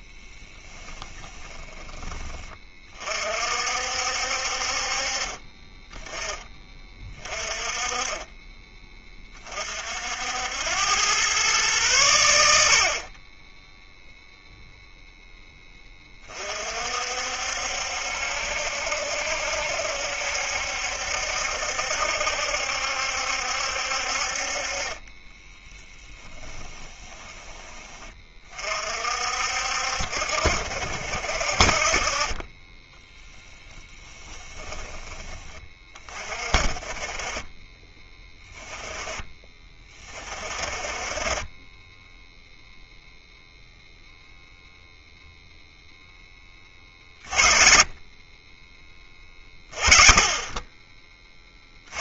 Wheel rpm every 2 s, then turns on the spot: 10, 30, 40, 20, 20, 100, 60, 0, 50, 70, 70, 70, 30, 20, 50, 60, 20, 10, 30, 10, 40, 0, 0, 30, 20, 20.
0-2 24-28